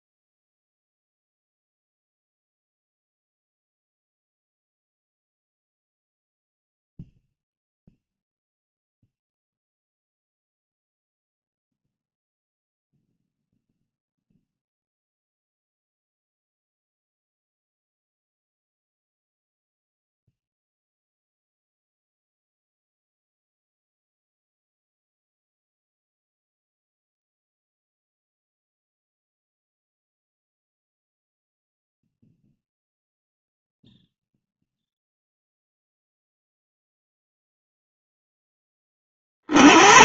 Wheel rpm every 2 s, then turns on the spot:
0, 0, 0, 0, 0, 0, 0, 0, 0, 0, 0, 0, 0, 0, 0, 0, 0, 0, 0, 10.
none